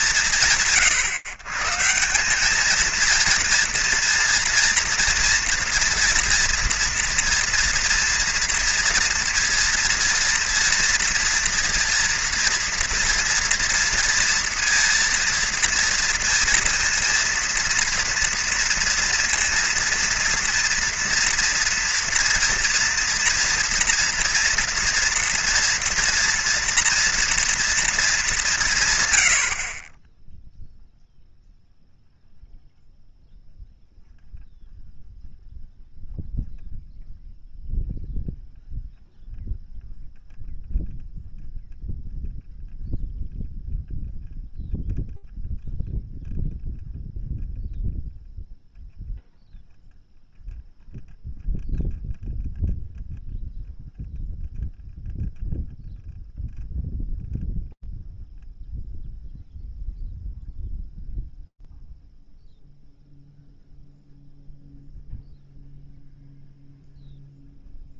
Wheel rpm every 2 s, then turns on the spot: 150, 230, 230, 230, 230, 230, 230, 230, 230, 230, 230, 240, 240, 230, 100, 0, 0, 0, 0, 0, 0, 0, 0, 0, 0, 0, 0, 0, 0, 0, 0, 0, 0, 0.
none